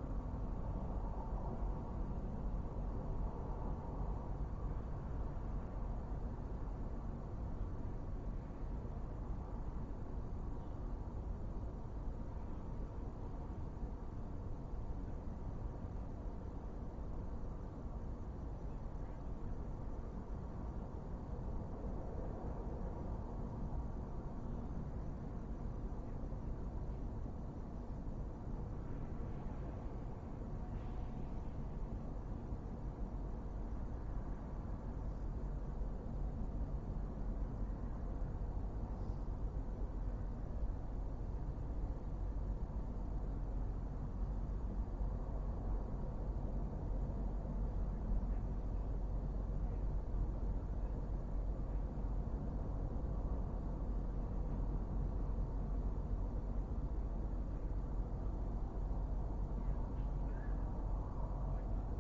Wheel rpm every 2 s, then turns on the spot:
0, 0, 0, 0, 0, 0, 0, 0, 0, 0, 0, 0, 0, 0, 0, 0, 0, 0, 0, 0, 0, 0, 0, 0, 0, 0, 0, 0, 0, 0, 0.
none